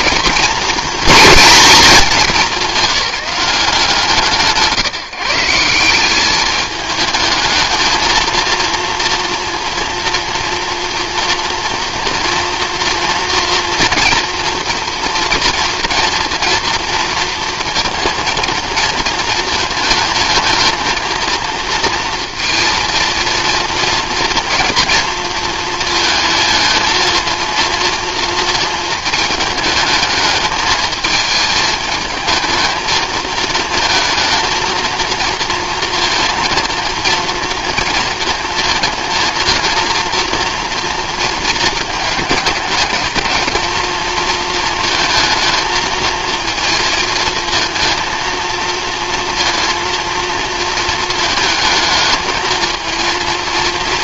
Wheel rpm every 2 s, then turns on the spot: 230, 190, 140, 200, 230, 230, 230, 230, 240, 230, 230, 230, 230, 220, 230, 220, 220, 230, 230, 230, 230, 210, 230, 230, 230, 230, 220.
none